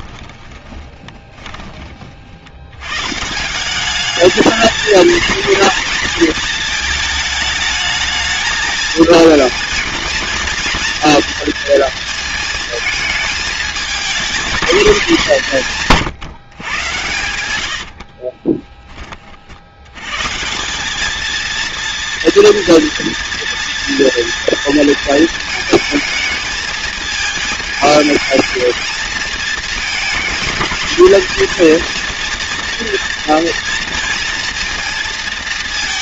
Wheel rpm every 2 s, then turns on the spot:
20, 130, 230, 220, 220, 230, 220, 210, 110, 30, 210, 230, 230, 220, 220, 220, 230, 230.
0-2